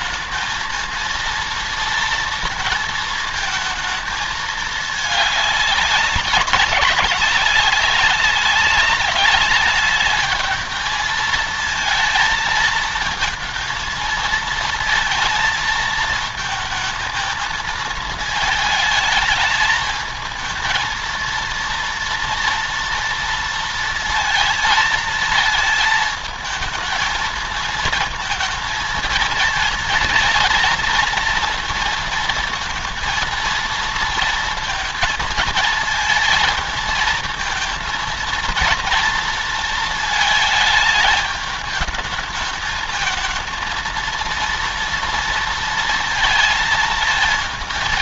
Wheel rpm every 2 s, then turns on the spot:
220, 230, 220, 200, 200, 210, 220, 230, 230, 220, 230, 230, 230, 220, 220, 230, 230, 230, 230, 230, 220, 220, 230, 220.
none